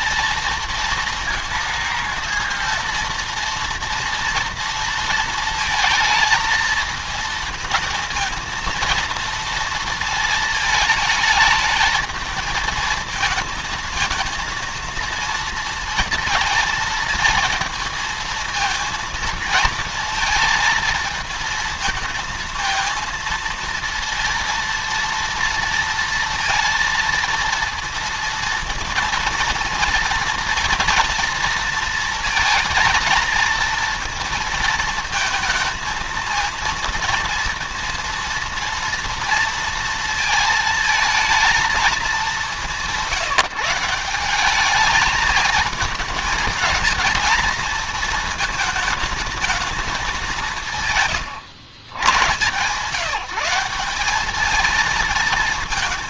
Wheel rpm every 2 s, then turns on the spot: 230, 230, 230, 230, 230, 220, 220, 230, 230, 230, 220, 230, 230, 230, 230, 230, 220, 220, 220, 230, 230, 200, 200, 220, 220, 170, 140, 210.
none